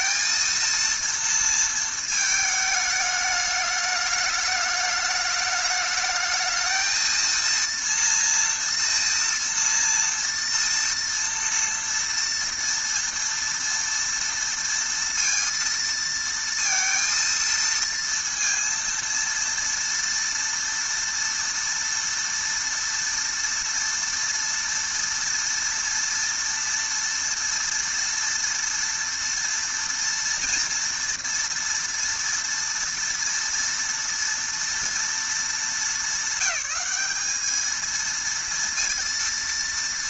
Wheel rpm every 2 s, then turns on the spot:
230, 220, 210, 220, 230, 230, 230, 230, 230, 230, 230, 230, 230, 230, 230, 240, 240, 230, 200, 230.
none